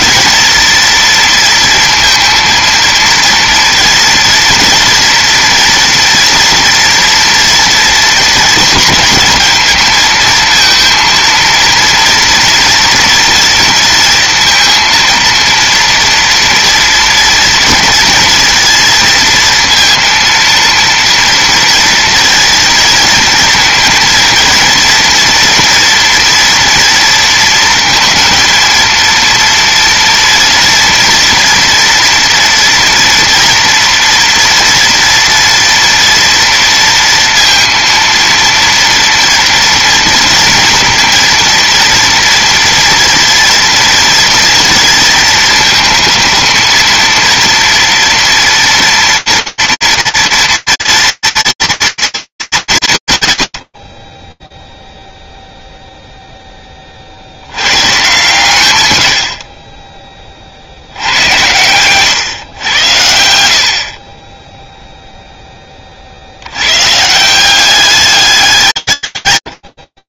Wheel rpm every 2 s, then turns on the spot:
220, 230, 230, 230, 230, 230, 240, 230, 230, 230, 230, 230, 230, 230, 220, 230, 230, 230, 230, 230, 230, 230, 230, 230, 230, 230, 230, 10, 10, 110, 80, 100, 0, 150, 160.
none